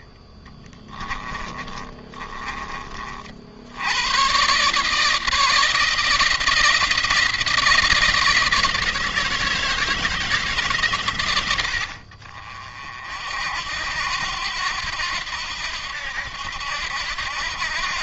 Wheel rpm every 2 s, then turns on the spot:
20, 30, 140, 170, 160, 140, 50, 80, 80.
0-2